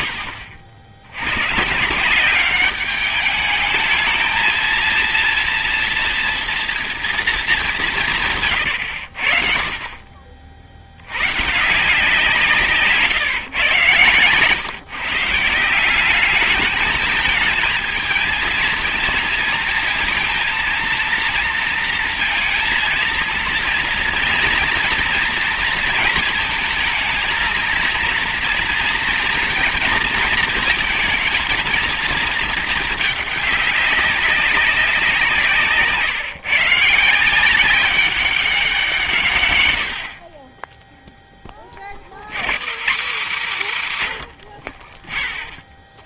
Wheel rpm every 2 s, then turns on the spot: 70, 200, 230, 230, 50, 80, 150, 140, 210, 230, 230, 230, 230, 230, 230, 220, 210, 180, 160, 160, 10, 200, 30.
none